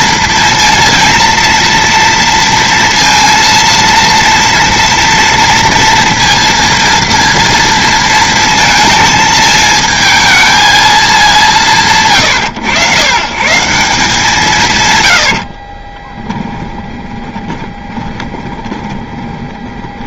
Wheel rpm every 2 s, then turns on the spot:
230, 230, 230, 230, 230, 220, 120, 140, 20, 20.
16-20